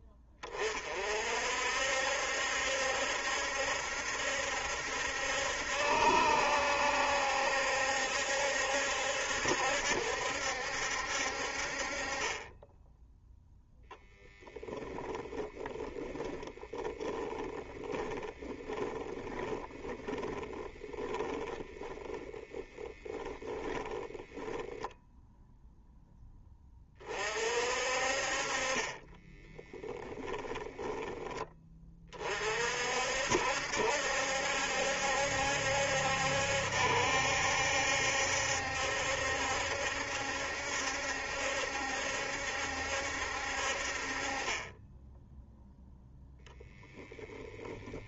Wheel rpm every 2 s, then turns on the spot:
30, 70, 70, 70, 70, 70, 10, 10, 10, 10, 10, 10, 10, 30, 30, 20, 50, 70, 70, 70, 70, 70, 20, 10.
16-24 30-32 46-48